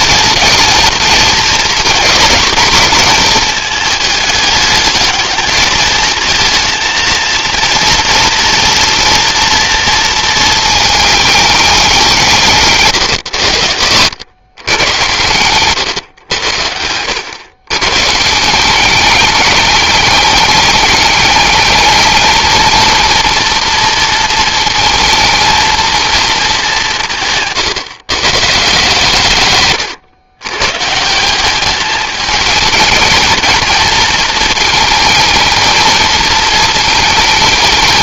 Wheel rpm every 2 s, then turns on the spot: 230, 230, 210, 220, 230, 220, 140, 120, 90, 190, 210, 230, 220, 190, 140, 140, 220, 220, 220.
none